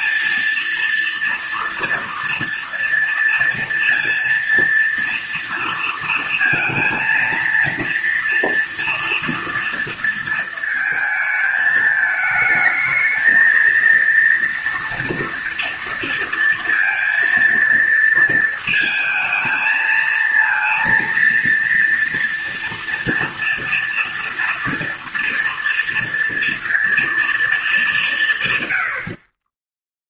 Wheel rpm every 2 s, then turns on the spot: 230, 230, 230, 230, 230, 230, 220, 230, 230, 230, 230, 230, 230, 230, 130.
none